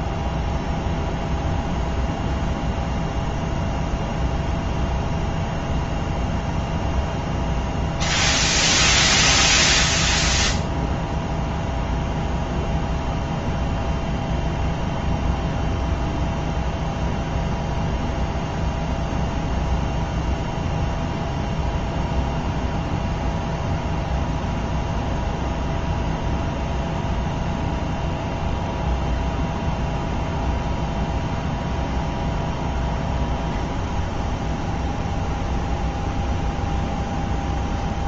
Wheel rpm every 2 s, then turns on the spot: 0, 0, 0, 0, 0, 0, 0, 0, 0, 0, 0, 0, 0, 0, 0, 0, 0, 0, 0.
none